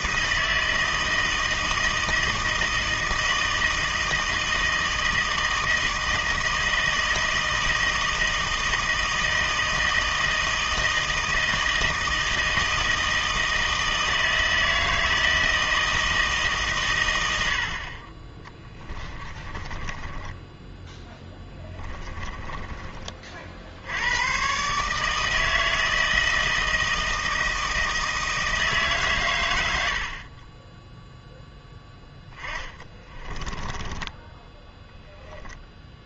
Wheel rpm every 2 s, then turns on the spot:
160, 160, 160, 160, 160, 160, 160, 160, 130, 20, 10, 20, 140, 160, 150, 10, 20, 10.
18-22 32-34